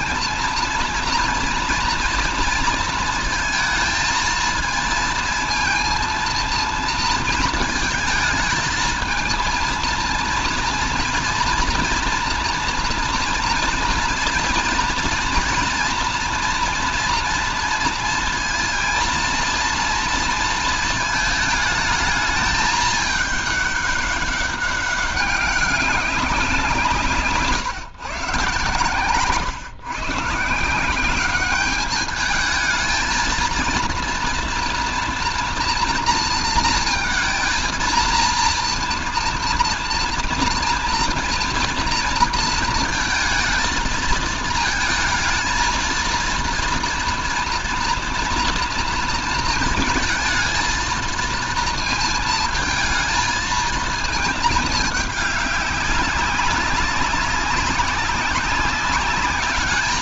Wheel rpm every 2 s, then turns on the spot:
230, 230, 230, 230, 220, 230, 240, 230, 230, 230, 220, 210, 200, 180, 140, 170, 220, 230, 230, 230, 230, 230, 230, 230, 230, 230, 220, 210, 190, 200.
none